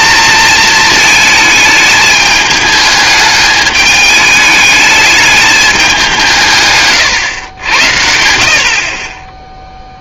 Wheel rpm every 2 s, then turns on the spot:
220, 210, 210, 150, 50.
6-8